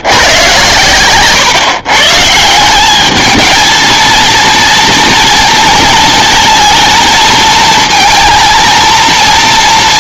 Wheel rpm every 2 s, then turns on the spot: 120, 170, 230, 230, 230.
none